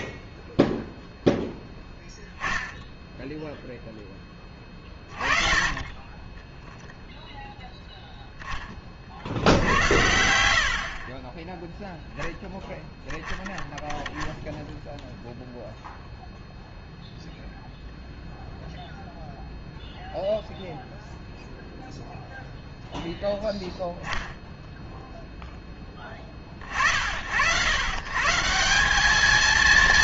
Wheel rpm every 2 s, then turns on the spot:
0, 10, 30, 0, 10, 70, 10, 0, 0, 0, 0, 0, 0, 50, 180.
10-12